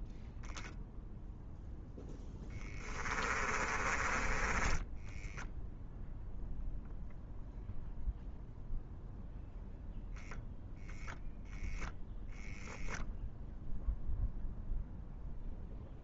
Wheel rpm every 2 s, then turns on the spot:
0, 10, 10, 0, 0, 0, 0, 0.
2-6